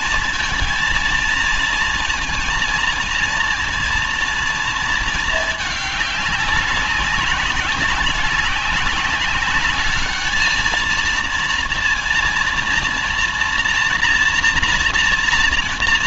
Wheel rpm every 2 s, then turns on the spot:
230, 230, 230, 200, 190, 220, 230, 230.
none